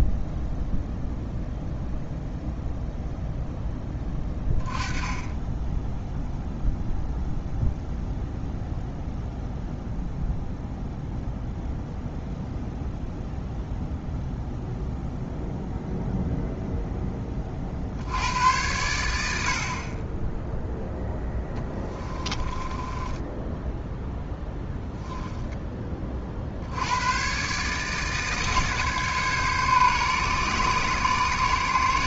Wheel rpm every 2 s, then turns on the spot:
0, 0, 10, 0, 0, 0, 0, 0, 10, 80, 10, 10, 10, 110, 140, 120.
20-26